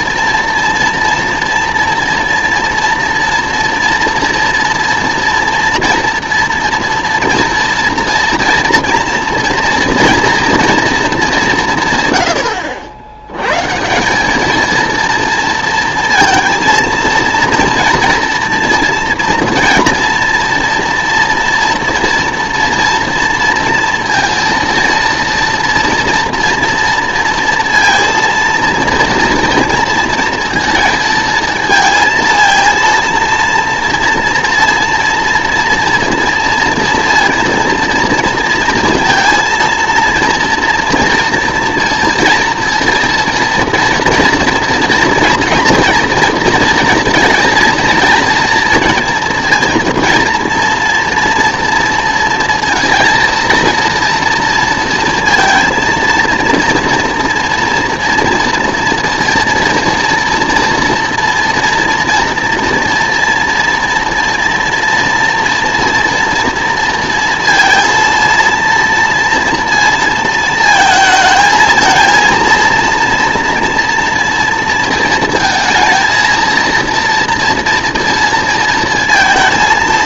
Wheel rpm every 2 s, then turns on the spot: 240, 230, 230, 230, 230, 230, 90, 230, 230, 230, 230, 230, 230, 230, 230, 230, 230, 230, 230, 230, 230, 230, 230, 230, 230, 230, 230, 230, 230, 240, 230, 240, 230, 230, 230, 220, 230, 230, 230, 230.
none